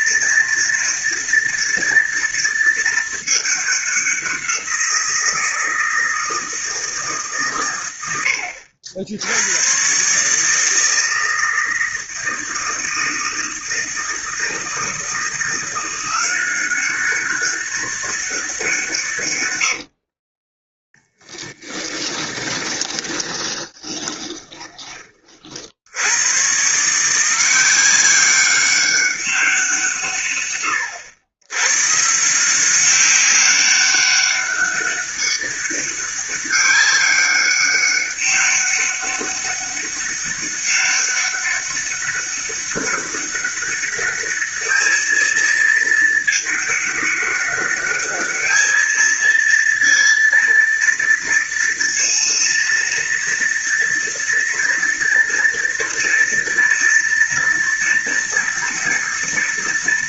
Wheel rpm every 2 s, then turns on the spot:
230, 220, 180, 160, 70, 160, 160, 160, 190, 170, 10, 20, 30, 150, 200, 100, 180, 200, 200, 200, 200, 200, 210, 210, 220, 230, 230, 230, 230, 240.
20-24